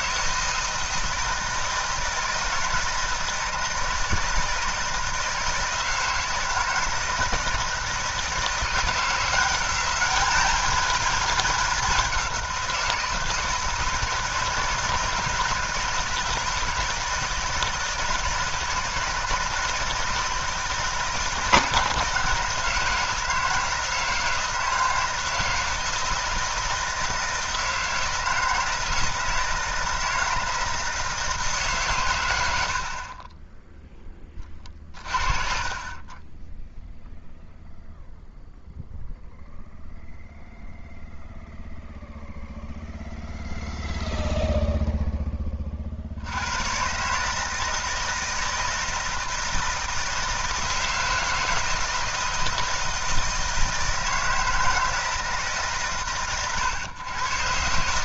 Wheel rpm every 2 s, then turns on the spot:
160, 170, 160, 160, 170, 220, 170, 160, 160, 160, 160, 160, 160, 160, 160, 160, 50, 40, 0, 0, 0, 0, 0, 130, 160, 160, 160, 160, 120.
34-36